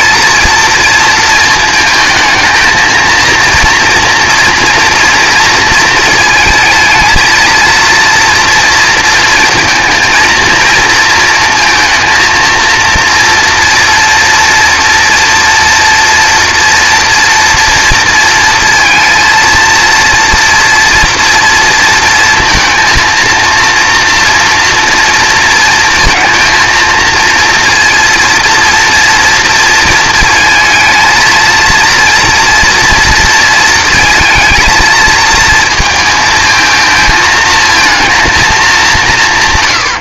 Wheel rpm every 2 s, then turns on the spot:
230, 220, 230, 220, 230, 230, 230, 240, 230, 230, 240, 230, 230, 230, 230, 220, 230, 230, 220, 210.
none